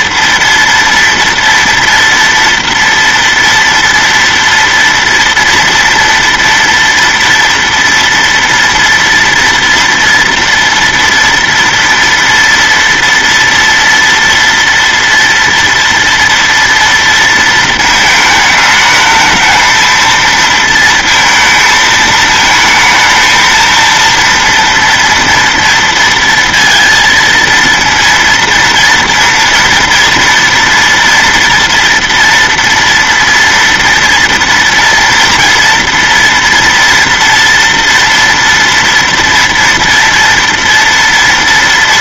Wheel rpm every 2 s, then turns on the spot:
230, 230, 230, 230, 230, 230, 230, 230, 230, 220, 230, 220, 230, 230, 230, 230, 240, 230, 230, 230, 230.
none